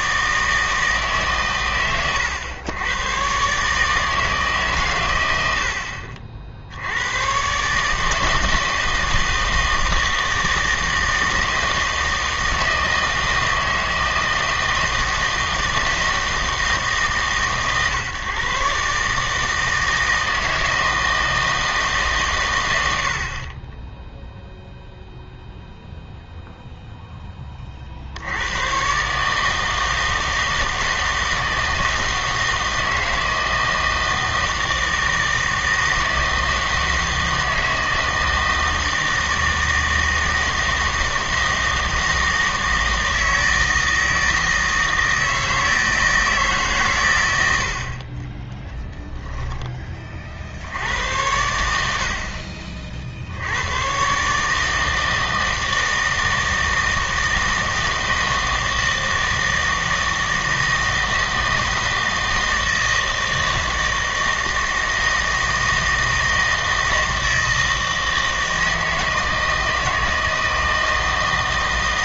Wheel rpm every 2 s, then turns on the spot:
160, 100, 140, 60, 160, 160, 160, 160, 160, 140, 160, 110, 0, 0, 110, 160, 160, 160, 160, 160, 160, 160, 160, 140, 10, 80, 40, 160, 160, 160, 160, 160, 160, 160, 160, 160.
48-50